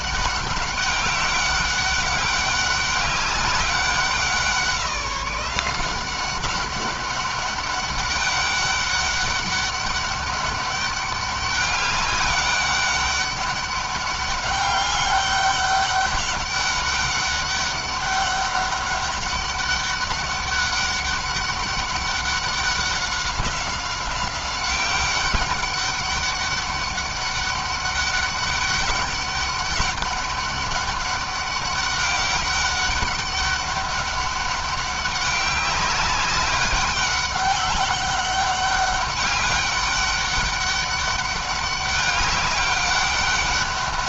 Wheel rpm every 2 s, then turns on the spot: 200, 200, 180, 200, 200, 200, 200, 200, 200, 200, 200, 200, 190, 200, 200, 200, 200, 200, 200, 200, 200, 200.
none